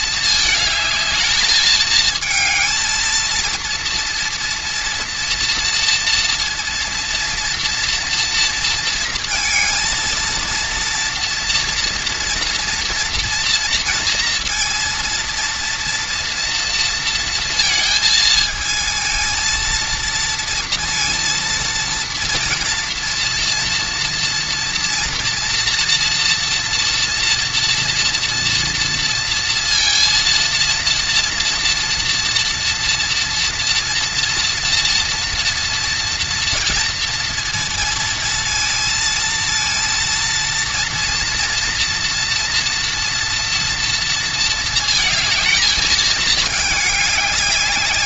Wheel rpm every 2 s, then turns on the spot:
220, 220, 230, 230, 230, 230, 240, 230, 230, 220, 230, 230, 230, 230, 230, 230, 230, 230, 230, 230, 230, 240, 220, 210.
none